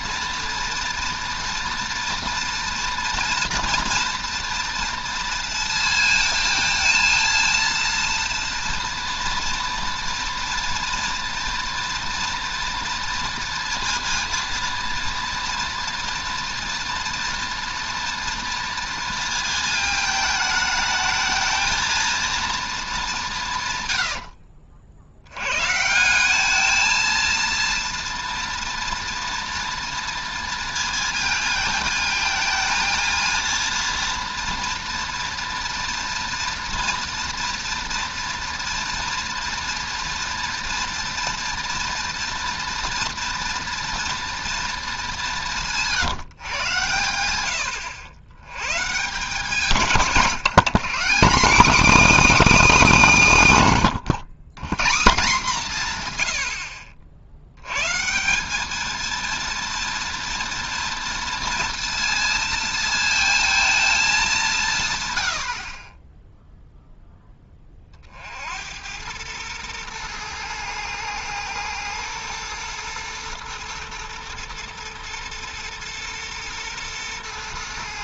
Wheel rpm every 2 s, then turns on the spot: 240, 230, 230, 220, 230, 230, 230, 230, 230, 230, 220, 220, 70, 220, 230, 230, 220, 240, 230, 230, 240, 240, 230, 120, 130, 180, 300, 160, 70, 210, 230, 230, 170, 0, 80, 110, 120, 120, 120.
none